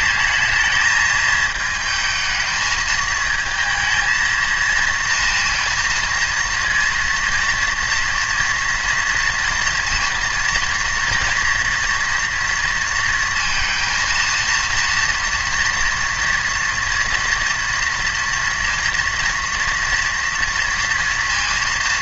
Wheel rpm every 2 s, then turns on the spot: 220, 220, 230, 230, 230, 230, 230, 230, 230, 240, 230.
none